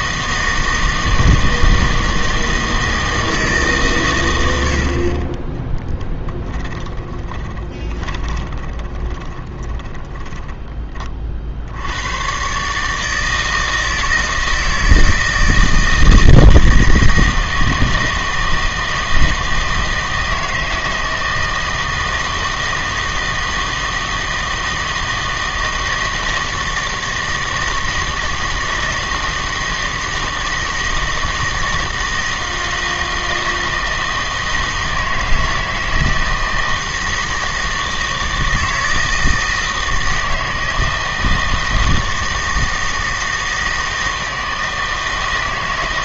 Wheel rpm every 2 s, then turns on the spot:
160, 160, 80, 10, 10, 20, 140, 160, 160, 160, 160, 160, 160, 160, 160, 160, 160, 160, 160, 160, 160, 160, 160.
6-10